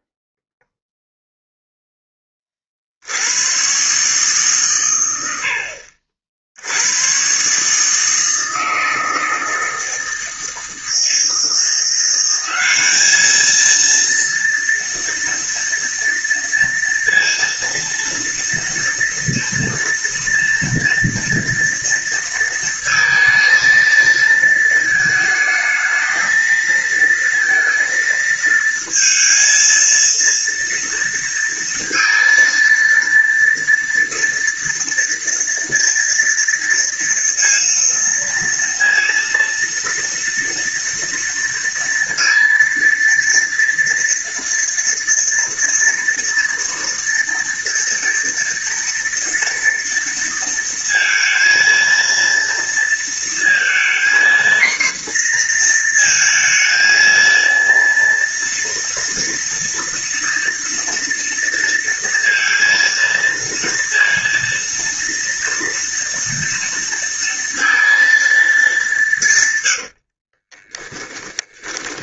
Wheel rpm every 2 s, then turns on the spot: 0, 60, 110, 100, 160, 160, 200, 230, 230, 230, 230, 230, 220, 220, 230, 230, 230, 230, 230, 230, 230, 230, 230, 230, 240, 230, 230, 240, 230, 230, 230, 230, 230, 230, 190, 10.
70-72